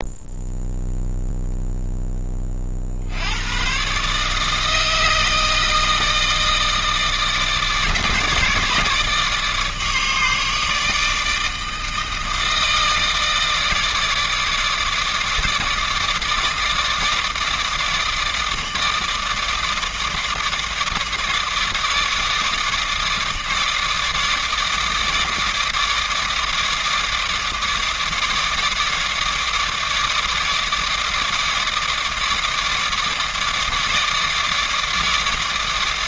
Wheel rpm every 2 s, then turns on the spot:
0, 50, 160, 160, 150, 150, 160, 150, 150, 160, 150, 150, 150, 150, 150, 150, 150, 150.
none